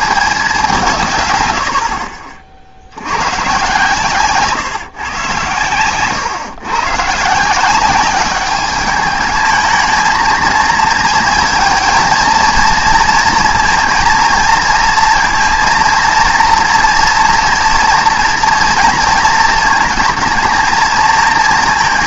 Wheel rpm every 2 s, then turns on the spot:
200, 60, 130, 130, 210, 230, 230, 230, 230, 230, 220.
none